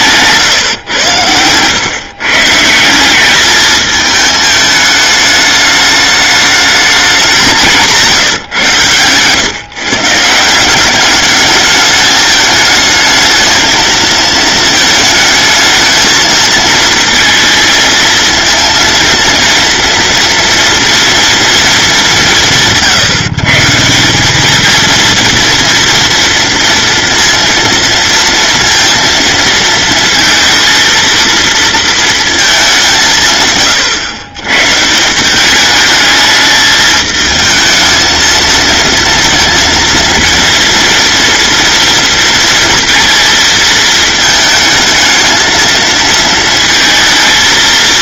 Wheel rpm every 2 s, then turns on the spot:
120, 180, 210, 210, 110, 180, 210, 220, 230, 230, 230, 150, 220, 230, 230, 230, 170, 160, 220, 230, 230, 230, 220, 220.
none